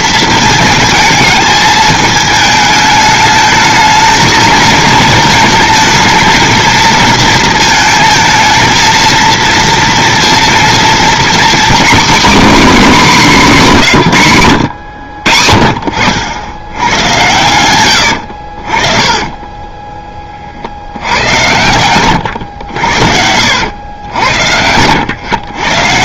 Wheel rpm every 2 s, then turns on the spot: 220, 220, 220, 220, 230, 250, 220, 60, 100, 20, 100, 70, 90.
18-20 22-24